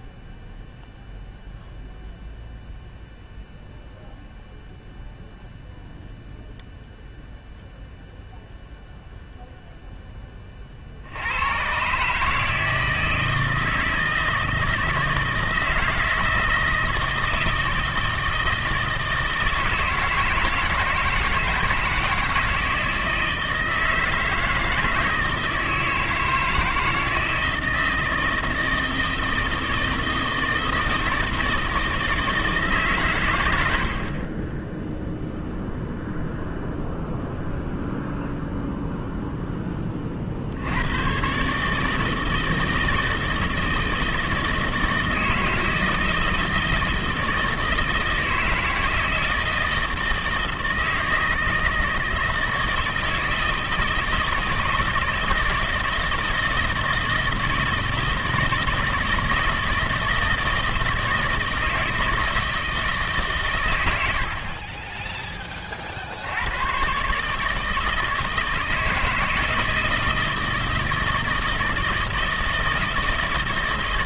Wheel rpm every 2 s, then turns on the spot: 0, 0, 0, 0, 0, 40, 160, 160, 160, 160, 160, 160, 160, 160, 160, 160, 150, 10, 0, 0, 90, 160, 160, 160, 160, 160, 160, 160, 160, 160, 160, 160, 30, 110, 160, 160, 160.
34-36